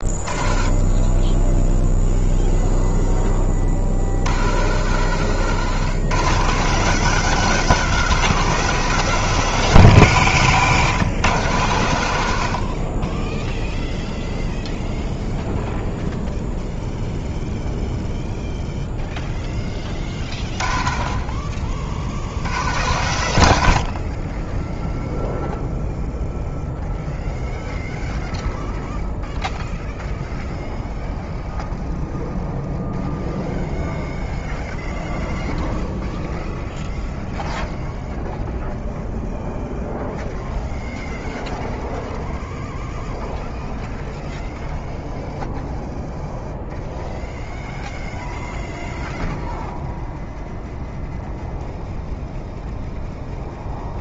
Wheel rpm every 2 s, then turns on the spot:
20, 0, 130, 180, 190, 130, 40, 0, 0, 0, 40, 120, 0, 0, 0, 0, 0, 0, 0, 0, 0, 0, 0, 0, 0, 0, 0.
none